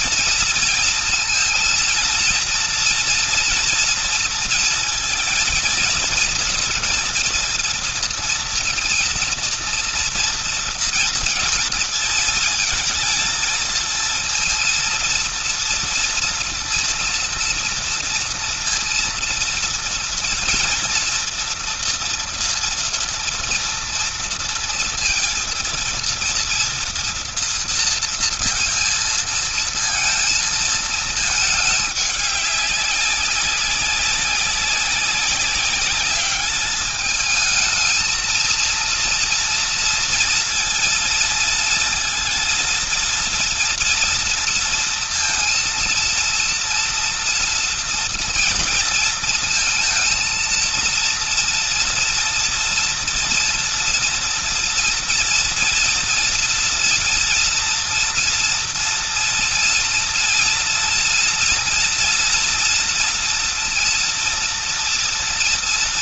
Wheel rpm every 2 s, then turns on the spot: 230, 230, 230, 230, 230, 230, 230, 230, 230, 230, 230, 230, 230, 230, 230, 230, 200, 190, 210, 230, 230, 230, 230, 230, 230, 230, 230, 230, 230, 230, 240, 230, 230.
none